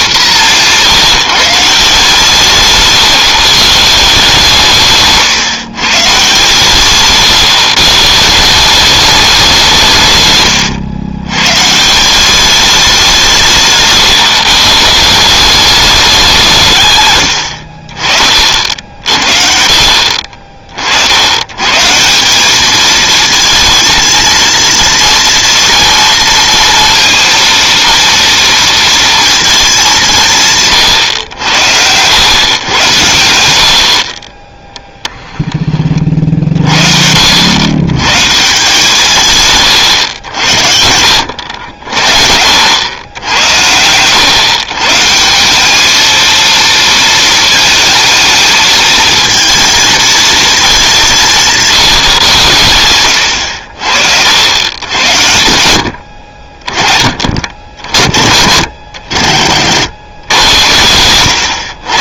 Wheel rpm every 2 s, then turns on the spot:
180, 140, 160, 140, 180, 110, 200, 140, 140, 50, 50, 210, 230, 230, 230, 140, 120, 10, 60, 160, 80, 80, 140, 230, 220, 210, 100, 100, 40, 80, 110.
4-8